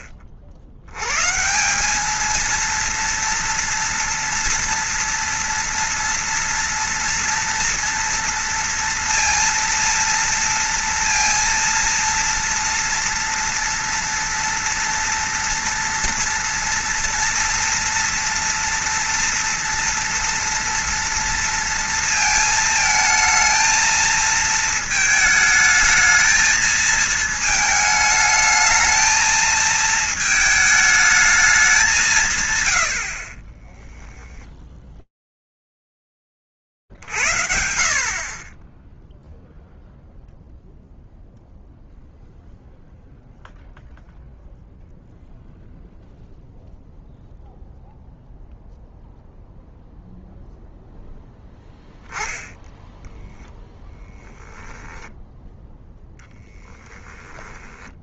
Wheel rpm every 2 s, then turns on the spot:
70, 230, 240, 240, 230, 230, 230, 230, 230, 240, 230, 220, 220, 220, 220, 220, 60, 30, 10, 50, 0, 0, 0, 0, 0, 0, 0, 0, 10.
56-58